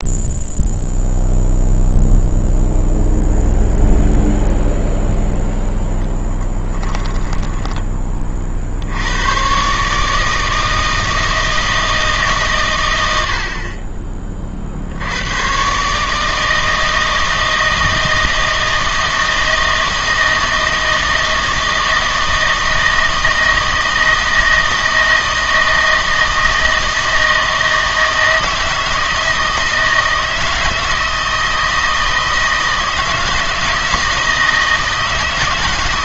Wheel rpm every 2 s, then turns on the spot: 0, 0, 0, 10, 60, 160, 130, 50, 160, 160, 160, 160, 160, 160, 160, 160, 160, 160.
6-8